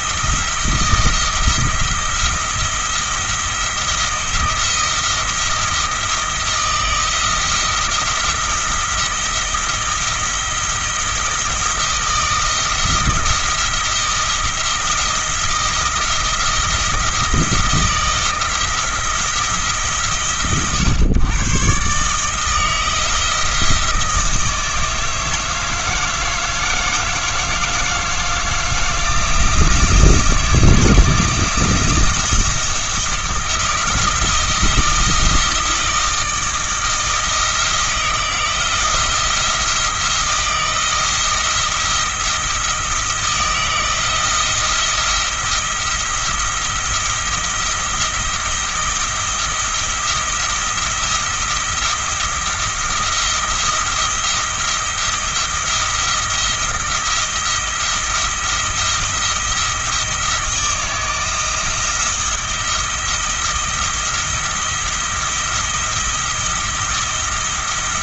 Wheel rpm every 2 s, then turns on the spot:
170, 170, 170, 170, 170, 170, 160, 170, 170, 160, 120, 160, 160, 160, 160, 170, 170, 160, 160, 170, 160, 170, 170, 170, 170, 170, 170, 170, 170, 170, 160, 170, 170, 170.
none